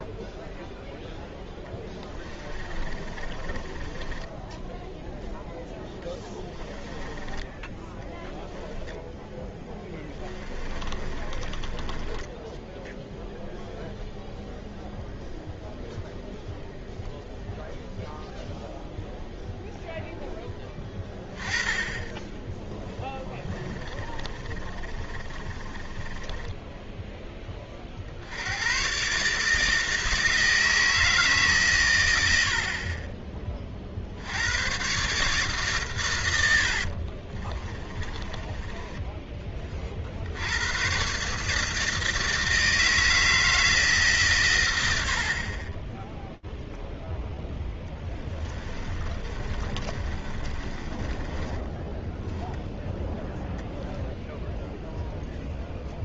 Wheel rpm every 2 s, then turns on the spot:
0, 20, 10, 30, 10, 20, 10, 0, 0, 0, 10, 20, 30, 10, 90, 160, 70, 90, 80, 20, 80, 160, 120, 0, 20, 30, 0, 0.
2-14 24-28 36-40 48-52